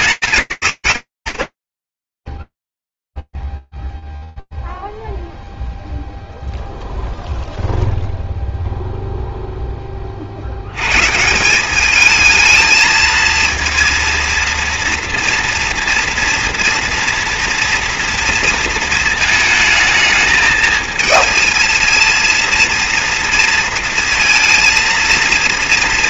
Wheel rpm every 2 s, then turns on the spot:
120, 10, 0, 0, 0, 140, 230, 240, 230, 220, 220, 230, 230.
none